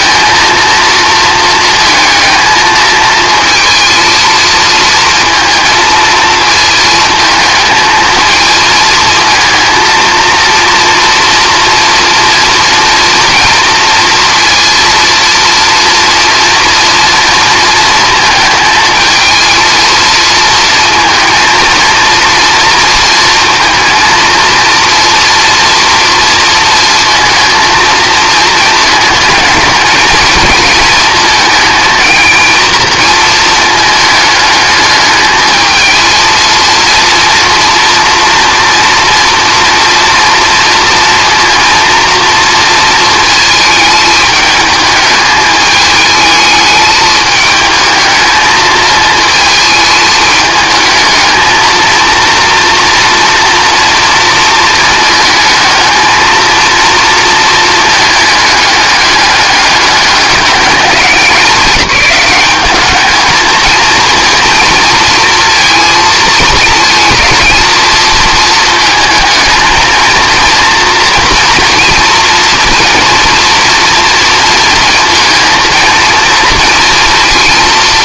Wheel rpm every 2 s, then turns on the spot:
230, 220, 230, 220, 230, 230, 240, 230, 230, 220, 230, 240, 230, 230, 220, 220, 230, 210, 230, 230, 230, 230, 210, 220, 220, 220, 230, 220, 230, 210, 200, 200, 230, 230, 220, 230, 240, 230, 230.
none